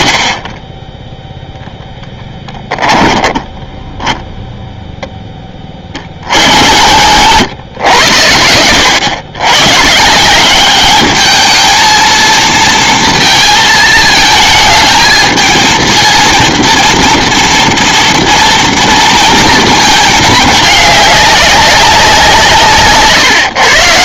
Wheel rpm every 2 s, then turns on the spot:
10, 10, 0, 60, 90, 200, 230, 220, 230, 230, 210, 140.
2-4 6-8